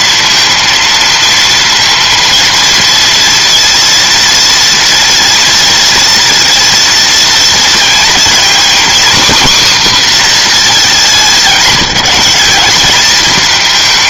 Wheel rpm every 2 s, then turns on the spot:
230, 230, 230, 230, 250, 200, 210.
none